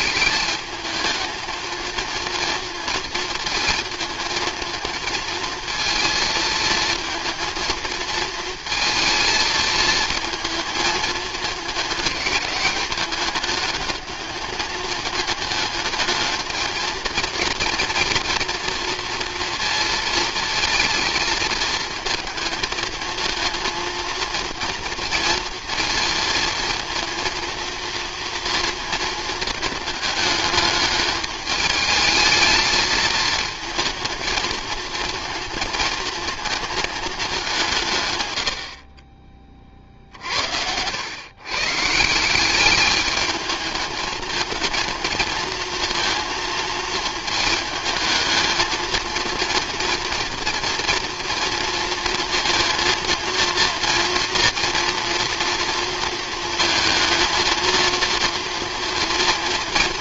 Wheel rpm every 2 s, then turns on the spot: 220, 230, 220, 230, 230, 220, 210, 210, 220, 240, 230, 220, 220, 230, 230, 210, 220, 220, 220, 50, 80, 200, 220, 220, 220, 230, 230, 230, 230, 230.
none